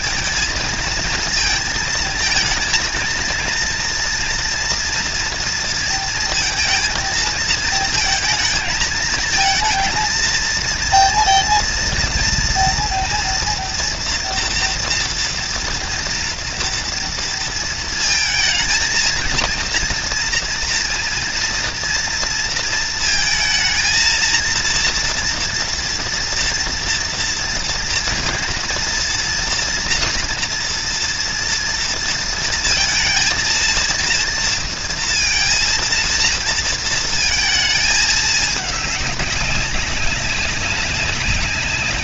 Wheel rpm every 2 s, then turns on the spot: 230, 230, 230, 220, 220, 230, 230, 230, 230, 230, 230, 220, 230, 230, 230, 230, 230, 230, 230, 200, 200.
none